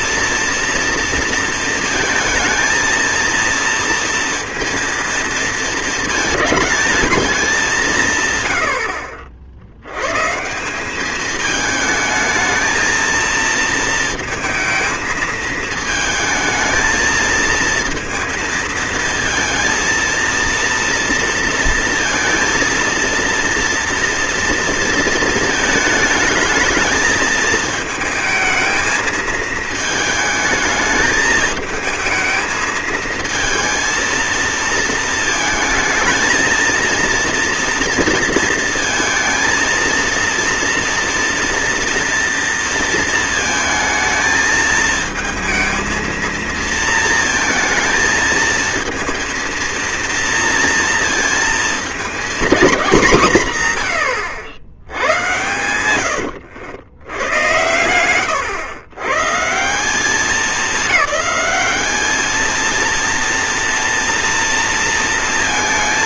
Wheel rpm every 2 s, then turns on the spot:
230, 230, 230, 200, 70, 220, 230, 220, 220, 230, 230, 230, 220, 220, 220, 220, 220, 220, 230, 230, 230, 230, 220, 230, 230, 230, 170, 100, 80, 140, 210, 230, 230.
none